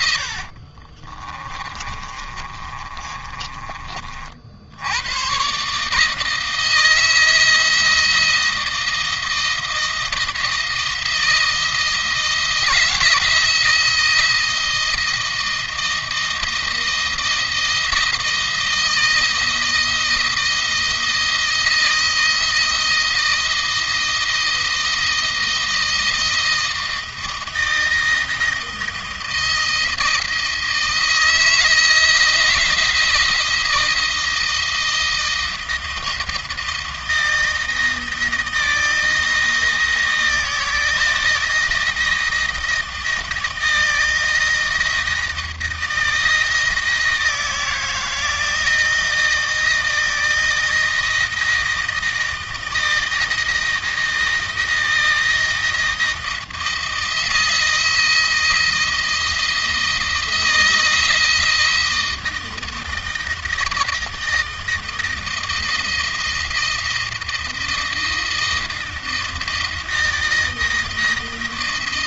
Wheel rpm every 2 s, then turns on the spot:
70, 30, 70, 160, 160, 160, 160, 160, 160, 160, 160, 160, 160, 160, 160, 170, 170, 160, 160, 160, 170, 170, 170, 170, 160, 160, 160, 160, 160, 160, 160, 160, 160, 160, 160, 160.
0-4